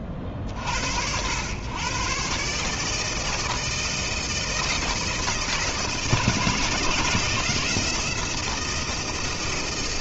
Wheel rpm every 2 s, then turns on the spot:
50, 140, 160, 160, 160.
none